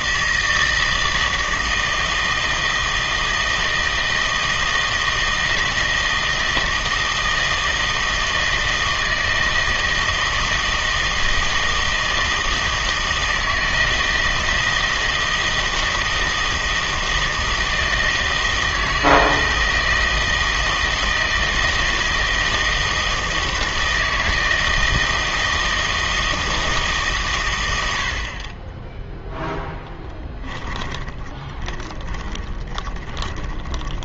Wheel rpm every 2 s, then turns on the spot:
160, 160, 160, 160, 160, 160, 160, 160, 160, 160, 160, 160, 160, 160, 20, 10, 20.
30-34